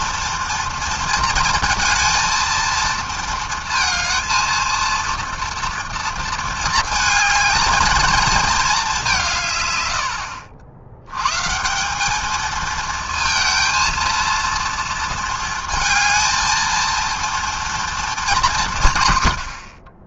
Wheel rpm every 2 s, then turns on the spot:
230, 230, 230, 220, 220, 70, 220, 230, 230, 180.
none